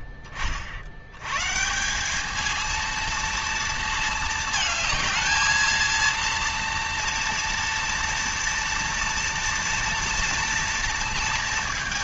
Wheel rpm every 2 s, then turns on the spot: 50, 210, 220, 230, 230, 230.
none